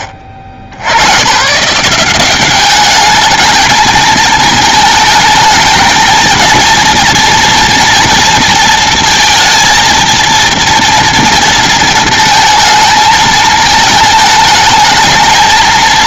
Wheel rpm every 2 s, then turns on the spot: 70, 210, 220, 230, 230, 230, 220, 220.
none